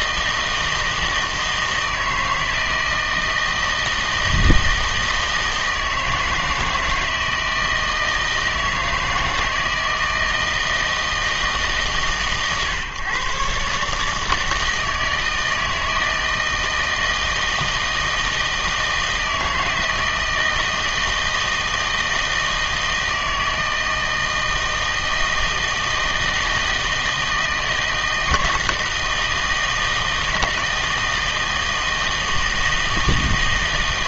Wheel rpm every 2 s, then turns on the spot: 160, 160, 160, 160, 160, 160, 140, 160, 160, 160, 160, 160, 160, 160, 160, 160, 160.
none